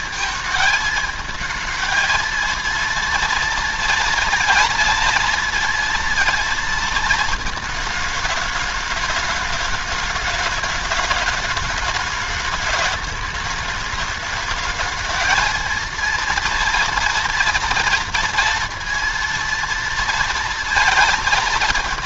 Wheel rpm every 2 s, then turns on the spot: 220, 230, 230, 230, 210, 210, 210, 220, 230, 230, 230.
none